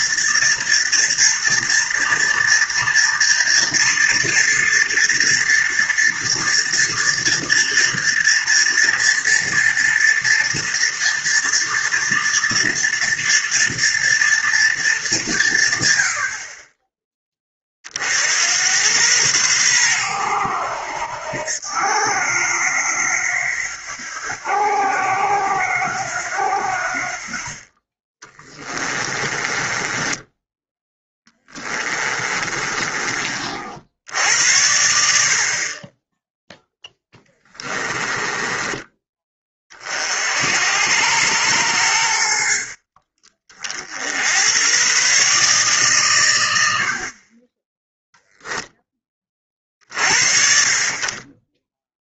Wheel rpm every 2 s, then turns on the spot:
230, 230, 230, 230, 230, 230, 230, 220, 20, 100, 90, 90, 90, 70, 20, 10, 30, 80, 0, 20, 80, 50, 110, 70, 0, 40.
28-34 38-40